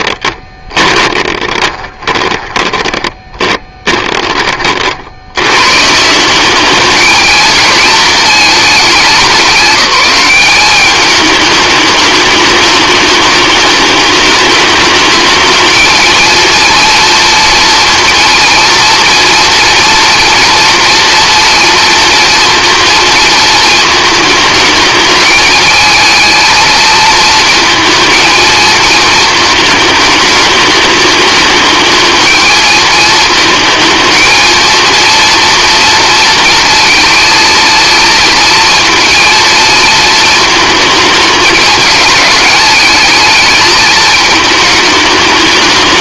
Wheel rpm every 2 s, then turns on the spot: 20, 20, 60, 210, 200, 200, 210, 210, 230, 230, 240, 230, 220, 220, 220, 210, 220, 230, 230, 230, 220, 210, 210.
0-4